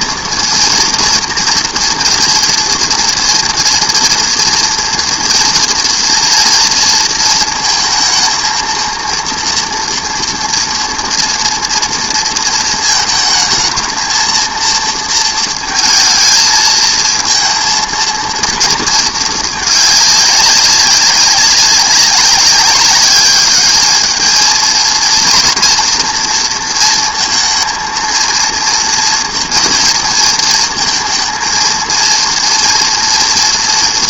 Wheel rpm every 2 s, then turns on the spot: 230, 230, 230, 230, 230, 230, 230, 230, 220, 230, 200, 200, 230, 230, 230, 220, 230.
none